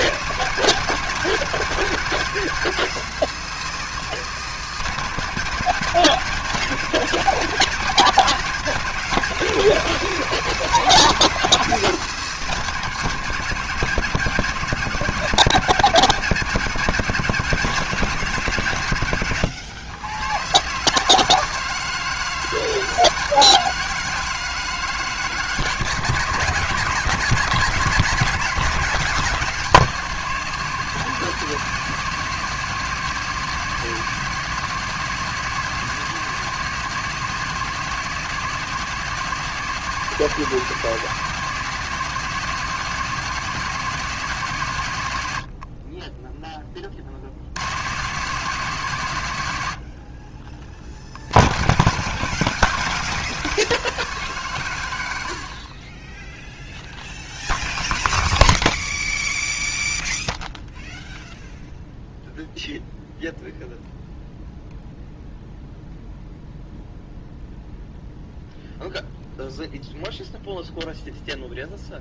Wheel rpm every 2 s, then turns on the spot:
150, 170, 150, 150, 160, 160, 150, 160, 150, 140, 130, 160, 160, 160, 180, 160, 160, 160, 160, 160, 160, 160, 130, 20, 140, 60, 170, 130, 0, 0, 0, 0, 0, 0, 0, 0.
none